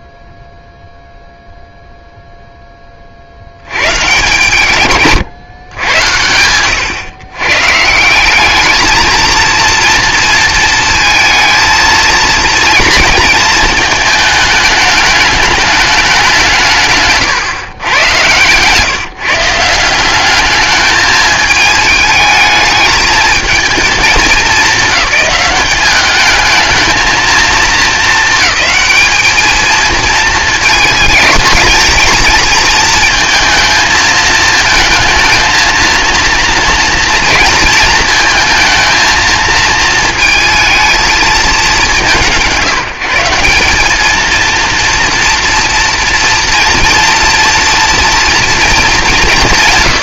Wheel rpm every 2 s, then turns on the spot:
0, 30, 150, 110, 220, 230, 230, 210, 150, 150, 210, 220, 190, 220, 210, 220, 220, 230, 230, 220, 220, 160, 230, 230, 210.
16-18